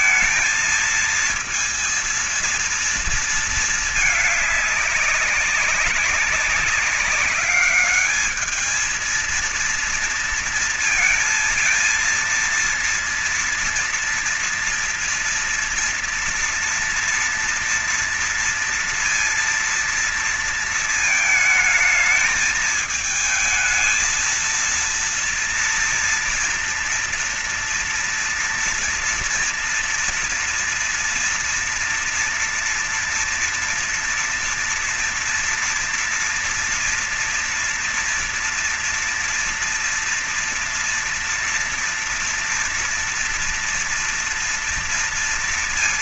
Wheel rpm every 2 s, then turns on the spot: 230, 230, 210, 190, 220, 230, 230, 230, 230, 230, 230, 210, 230, 230, 230, 230, 230, 230, 230, 230, 230, 230, 240.
none